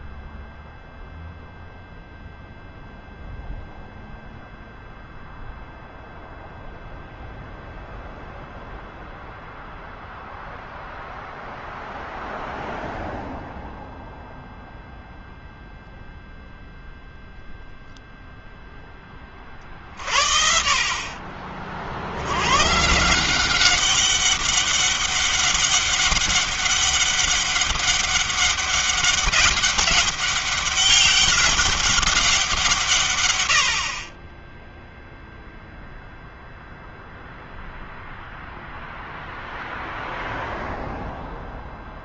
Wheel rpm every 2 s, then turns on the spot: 0, 0, 0, 0, 0, 0, 0, 0, 0, 0, 50, 80, 200, 200, 200, 200, 180, 20, 0, 0, 0.
none